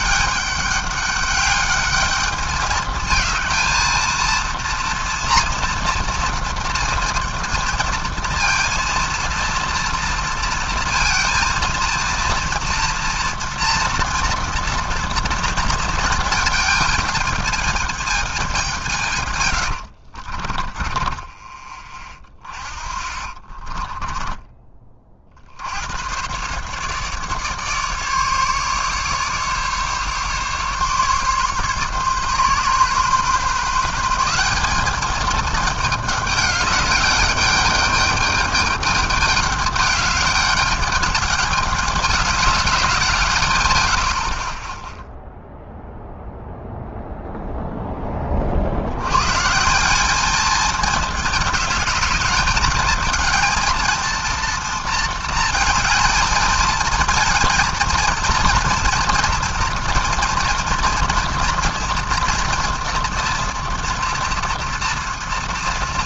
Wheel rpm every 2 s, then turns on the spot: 210, 210, 230, 230, 230, 230, 230, 230, 220, 170, 20, 20, 30, 130, 150, 140, 130, 200, 210, 210, 210, 190, 20, 0, 60, 210, 220, 230, 220, 230, 230, 240, 240.
20-24